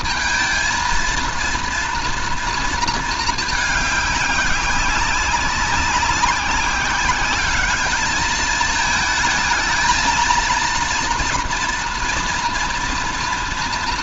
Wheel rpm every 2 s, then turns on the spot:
220, 230, 190, 190, 220, 230, 230.
none